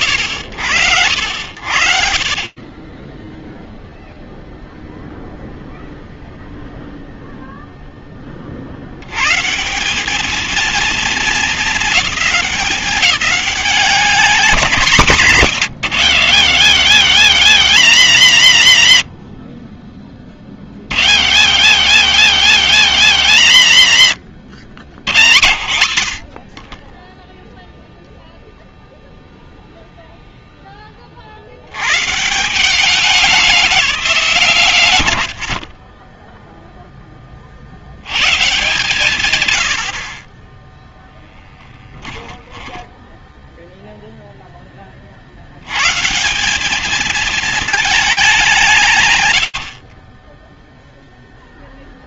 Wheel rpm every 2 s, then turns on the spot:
60, 0, 0, 0, 160, 220, 200, 150, 110, 20, 70, 90, 70, 0, 0, 70, 200, 60, 20, 140, 0, 10, 70, 220, 120, 0.
14-16 42-44